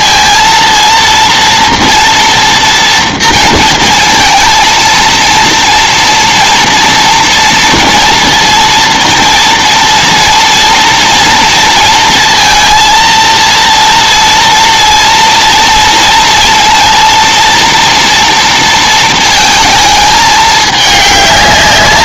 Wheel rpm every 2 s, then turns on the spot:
230, 230, 230, 230, 230, 230, 230, 230, 230, 230, 210.
none